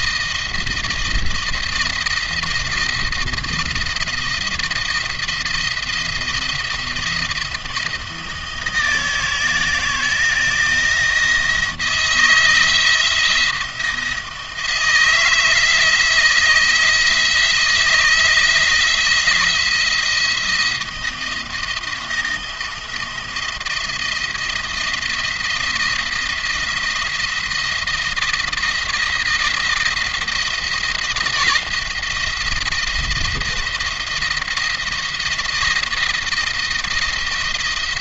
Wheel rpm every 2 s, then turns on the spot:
160, 170, 170, 170, 160, 160, 170, 160, 160, 170, 170, 170, 170, 170, 170, 160, 160, 170, 170.
none